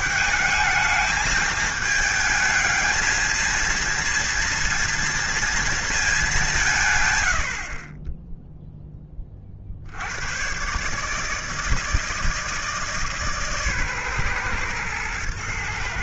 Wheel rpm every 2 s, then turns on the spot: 210, 220, 230, 170, 10, 130, 160, 120.
none